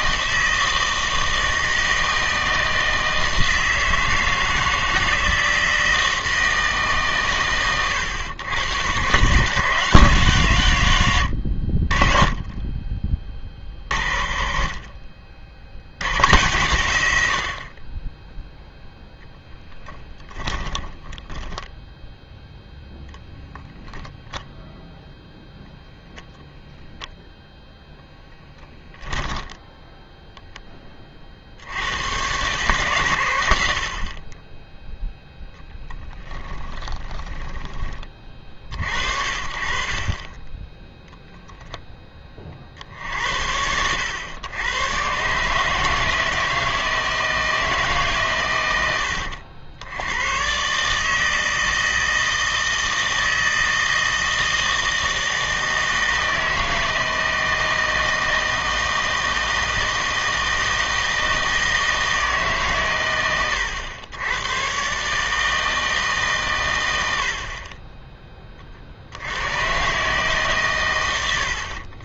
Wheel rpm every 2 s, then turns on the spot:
160, 160, 160, 150, 150, 110, 10, 40, 100, 0, 10, 0, 0, 0, 10, 10, 130, 10, 20, 50, 10, 40, 100, 160, 100, 130, 160, 160, 160, 160, 160, 130, 120, 110, 30, 130.
36-38 40-42